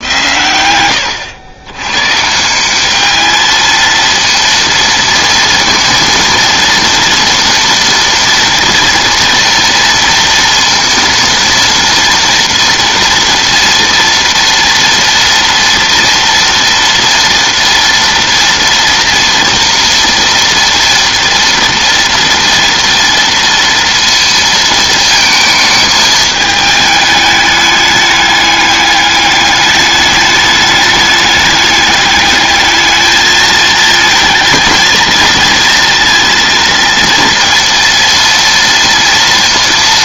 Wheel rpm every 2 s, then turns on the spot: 110, 200, 230, 230, 240, 230, 230, 230, 230, 230, 230, 230, 230, 210, 200, 210, 220, 230, 230, 230.
none